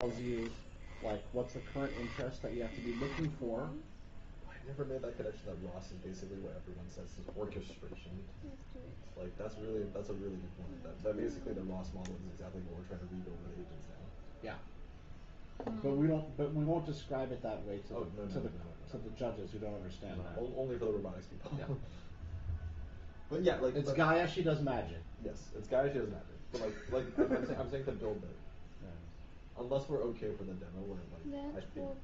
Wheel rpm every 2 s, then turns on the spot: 0, 0, 0, 0, 0, 0, 0, 0, 0, 0, 0, 0, 0, 0, 0, 0.
none